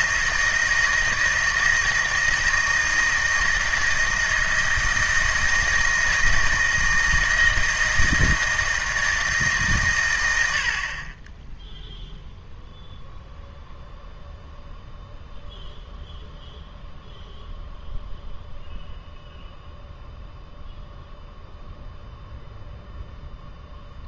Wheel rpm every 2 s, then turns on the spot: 160, 160, 160, 160, 160, 60, 0, 0, 0, 0, 0, 0.
none